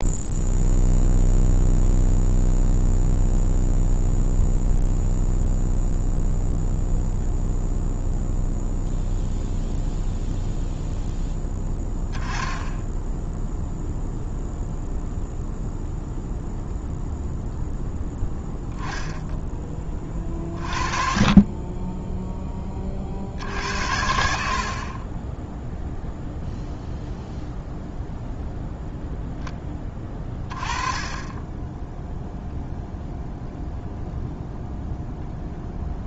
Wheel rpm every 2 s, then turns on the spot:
0, 0, 0, 0, 0, 0, 10, 0, 0, 0, 30, 30, 30, 0, 0, 20, 0, 0.
none